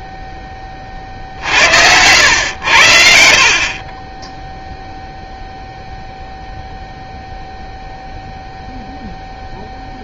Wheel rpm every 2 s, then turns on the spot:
20, 90, 0, 0, 0.
none